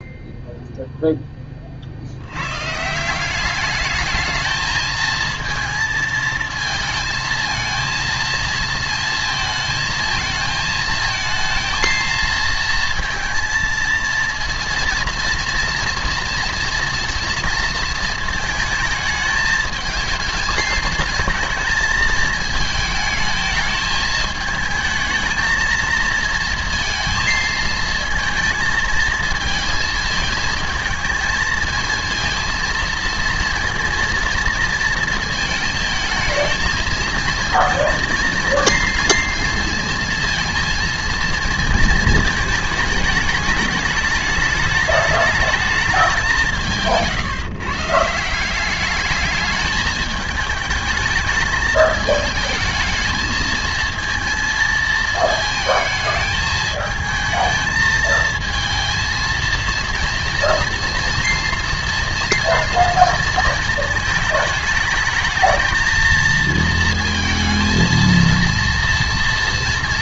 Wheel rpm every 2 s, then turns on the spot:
0, 140, 220, 230, 230, 220, 230, 230, 230, 220, 220, 220, 220, 230, 220, 220, 230, 230, 220, 230, 230, 220, 210, 180, 190, 220, 210, 230, 220, 230, 230, 230, 220, 220, 230.
none